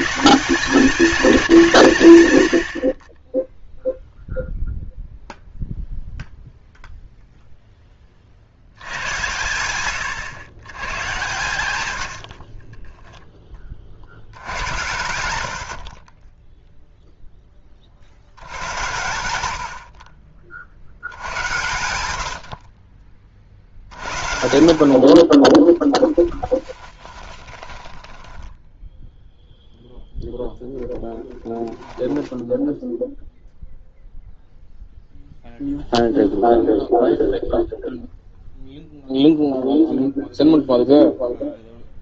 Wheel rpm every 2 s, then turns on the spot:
190, 70, 0, 0, 80, 100, 20, 90, 0, 90, 70, 50, 60, 20, 10, 0, 0, 0, 0, 0, 0.
12-14 26-28